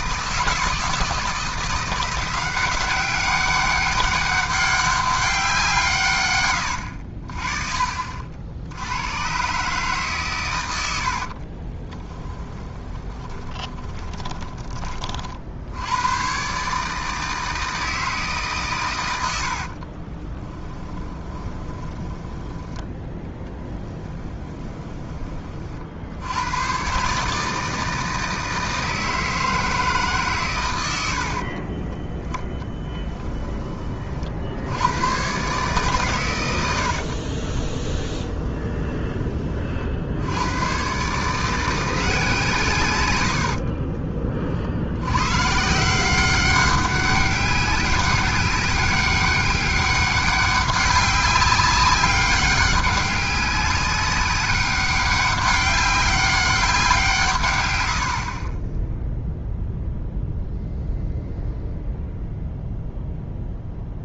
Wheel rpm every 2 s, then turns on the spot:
160, 180, 200, 90, 80, 100, 20, 30, 140, 120, 10, 10, 10, 120, 160, 100, 10, 90, 80, 20, 110, 130, 70, 190, 200, 200, 200, 200, 180, 10, 0, 0.
6-8 12-14 20-26 32-34 36-40